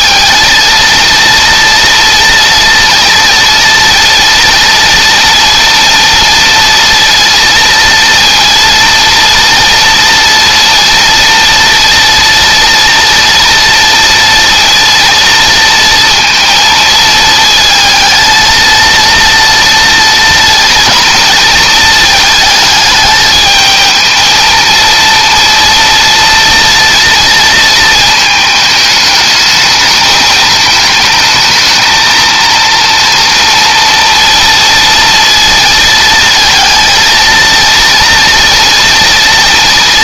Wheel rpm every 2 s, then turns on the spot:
230, 230, 230, 230, 230, 230, 230, 230, 220, 230, 230, 220, 230, 230, 210, 220, 230, 230, 230, 230.
none